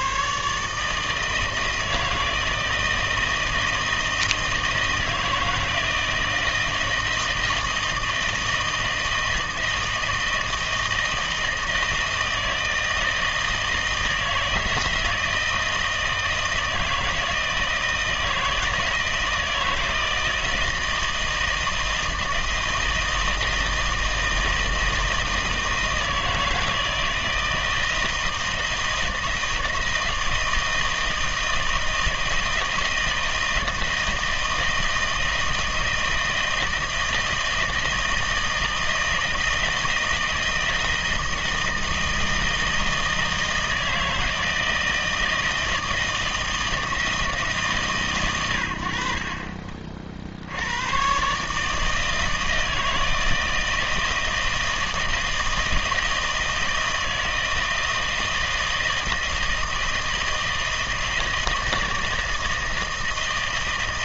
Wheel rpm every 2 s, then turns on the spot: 160, 160, 160, 160, 160, 160, 160, 160, 160, 160, 160, 160, 160, 160, 160, 160, 160, 160, 160, 160, 160, 160, 160, 160, 60, 120, 160, 160, 160, 160, 160, 160.
none